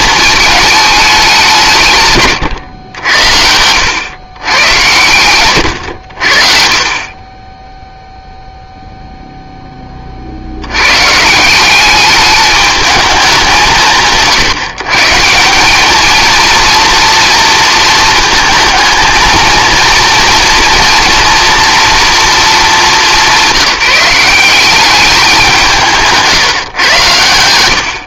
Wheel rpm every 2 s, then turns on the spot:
220, 120, 110, 50, 0, 110, 210, 150, 230, 230, 240, 220, 190, 150.
none